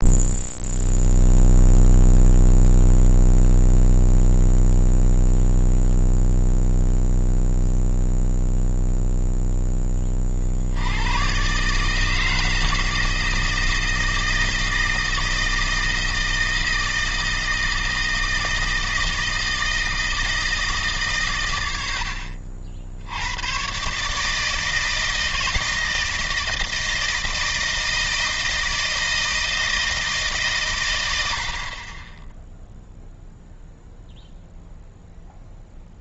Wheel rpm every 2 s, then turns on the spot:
0, 0, 0, 0, 0, 70, 160, 160, 160, 160, 150, 80, 160, 160, 160, 120, 0, 0.
none